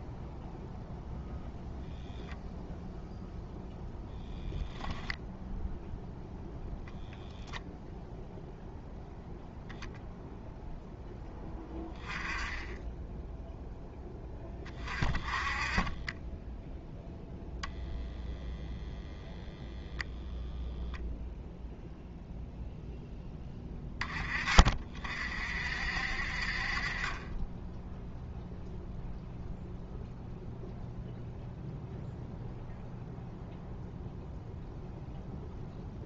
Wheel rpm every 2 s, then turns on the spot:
0, 0, 0, 0, 0, 0, 10, 20, 10, 0, 0, 0, 30, 40, 0, 0, 0, 0.
none